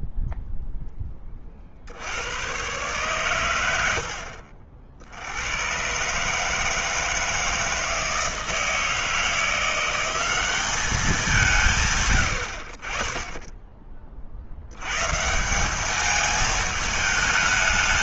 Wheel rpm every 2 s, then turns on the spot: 0, 100, 70, 150, 160, 200, 70, 80, 220.
none